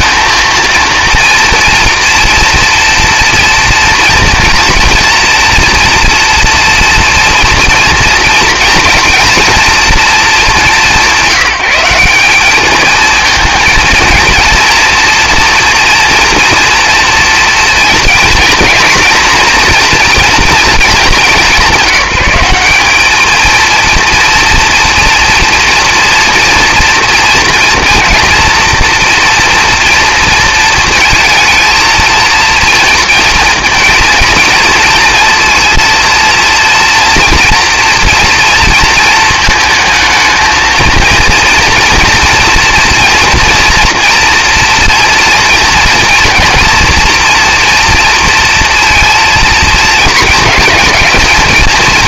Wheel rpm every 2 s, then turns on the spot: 230, 230, 230, 230, 230, 170, 220, 240, 230, 230, 190, 220, 240, 230, 240, 230, 230, 230, 230, 220, 230, 230, 230, 240, 230, 220.
none